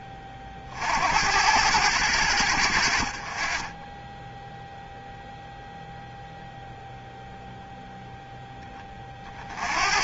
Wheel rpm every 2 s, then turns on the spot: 50, 60, 0, 0, 20.
none